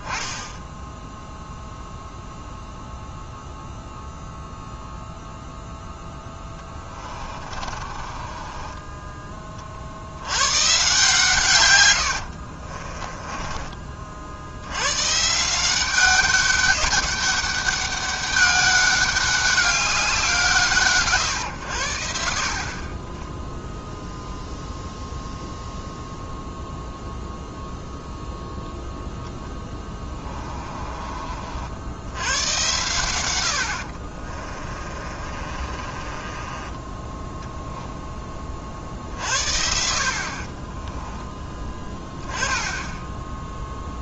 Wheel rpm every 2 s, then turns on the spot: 10, 0, 0, 20, 20, 130, 40, 100, 200, 200, 150, 40, 0, 0, 0, 30, 100, 30, 20, 50, 20, 10.
6-10 12-14 30-32 34-38 40-42